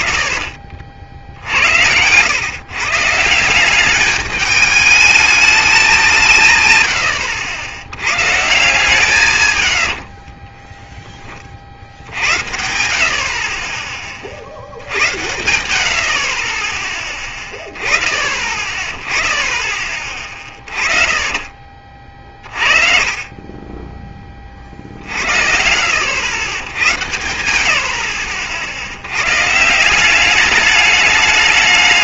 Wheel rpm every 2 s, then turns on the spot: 40, 140, 210, 130, 140, 20, 70, 60, 20, 40, 20, 40, 40, 100, 70, 200.
10-12 20-22